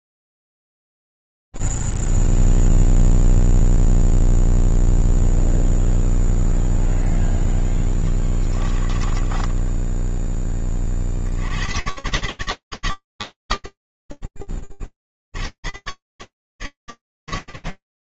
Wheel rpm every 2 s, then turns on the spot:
0, 0, 0, 0, 20, 20, 140, 60, 130.
8-10